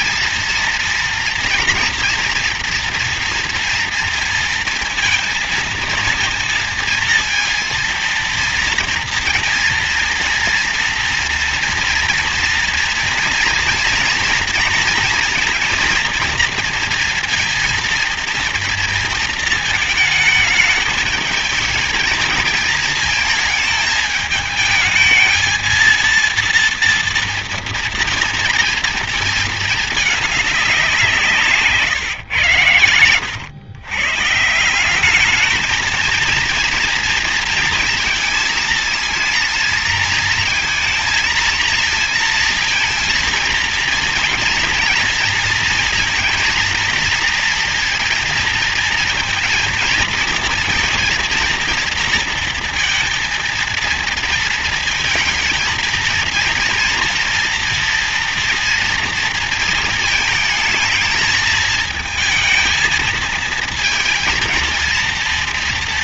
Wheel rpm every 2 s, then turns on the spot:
230, 240, 230, 220, 230, 230, 240, 230, 230, 230, 220, 220, 210, 230, 230, 210, 120, 160, 230, 230, 230, 230, 230, 230, 220, 230, 230, 230, 230, 240, 220, 220, 230.
none